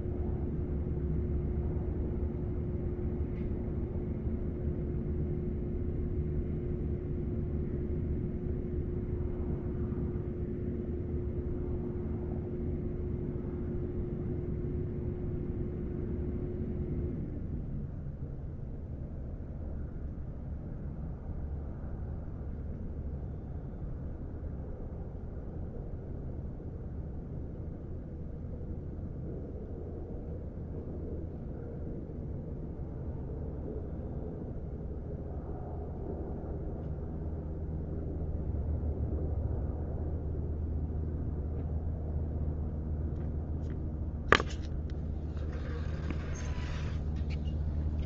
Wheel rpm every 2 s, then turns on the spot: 0, 0, 0, 0, 0, 0, 0, 0, 0, 0, 0, 0, 0, 0, 0, 0, 0, 0, 0, 0, 0, 0, 0, 0.
none